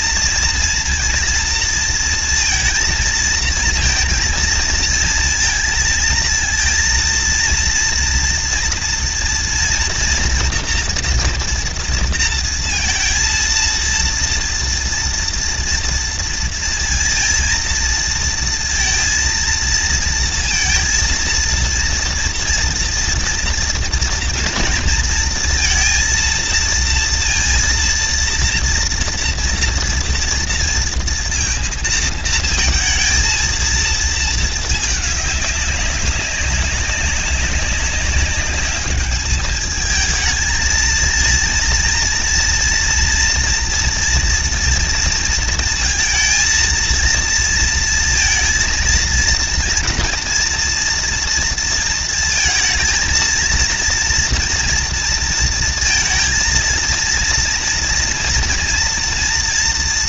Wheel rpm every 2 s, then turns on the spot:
230, 230, 230, 220, 230, 240, 230, 230, 230, 230, 230, 230, 230, 230, 230, 230, 220, 220, 200, 200, 220, 230, 230, 230, 230, 230, 230, 230, 230, 230.
none